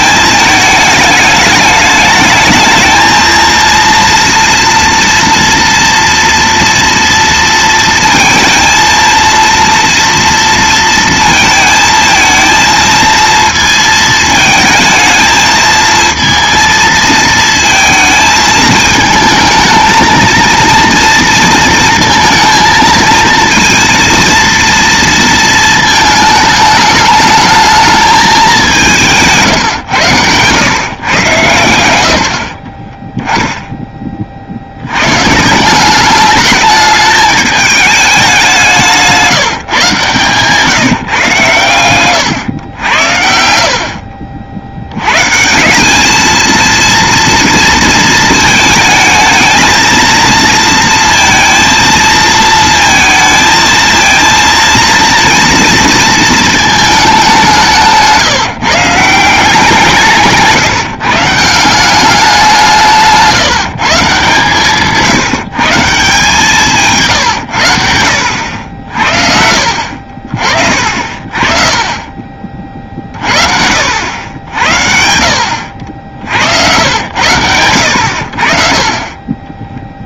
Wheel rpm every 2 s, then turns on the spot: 220, 220, 240, 230, 230, 230, 230, 220, 230, 220, 230, 230, 230, 210, 190, 130, 30, 80, 210, 180, 150, 100, 90, 230, 220, 230, 220, 230, 220, 160, 150, 170, 150, 160, 70, 50, 40, 80, 80, 30.
32-34